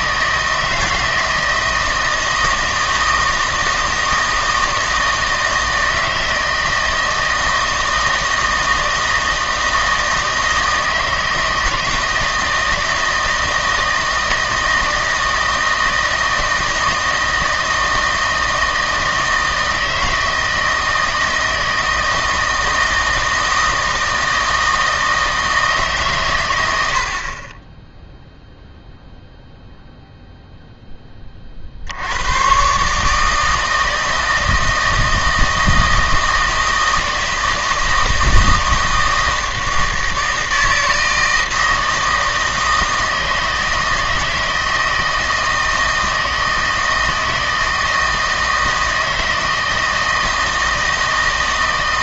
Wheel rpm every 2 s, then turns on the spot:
160, 160, 160, 160, 160, 160, 160, 160, 160, 160, 160, 160, 160, 80, 0, 10, 130, 160, 160, 160, 160, 160, 160, 160, 160, 160.
none